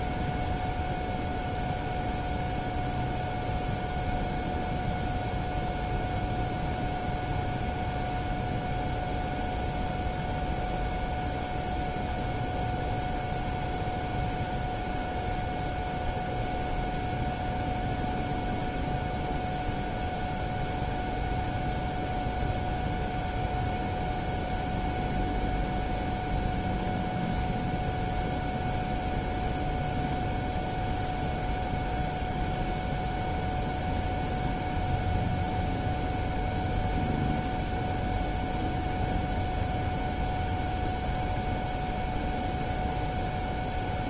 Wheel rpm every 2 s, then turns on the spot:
0, 0, 0, 0, 0, 0, 0, 0, 0, 0, 0, 0, 0, 0, 0, 0, 0, 0, 0, 0, 0, 0.
none